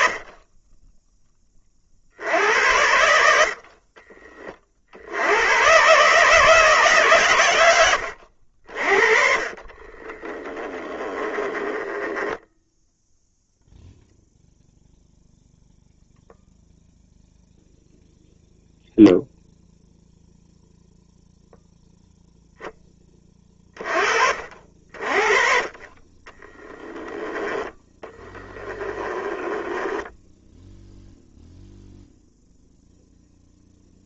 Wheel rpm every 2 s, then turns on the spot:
10, 80, 50, 160, 60, 20, 10, 0, 0, 0, 0, 0, 50, 20, 10, 0, 0.
10-12 26-30